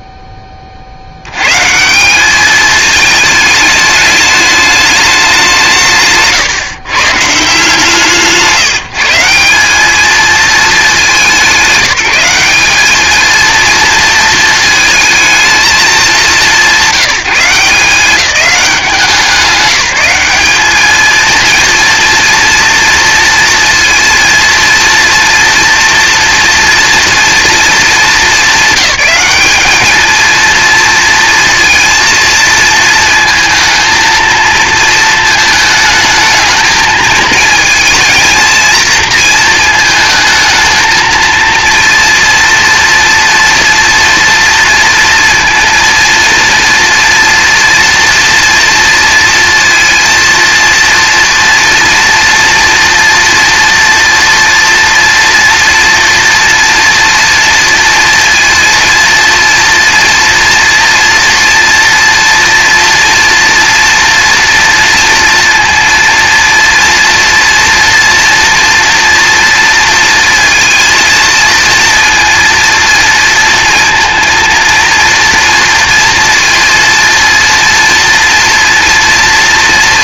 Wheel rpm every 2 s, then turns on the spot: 70, 210, 200, 150, 160, 200, 220, 220, 170, 170, 220, 230, 230, 230, 200, 230, 230, 220, 220, 220, 230, 230, 230, 230, 230, 230, 240, 230, 230, 230, 230, 230, 230, 230, 230, 230, 230, 230, 230, 240.
none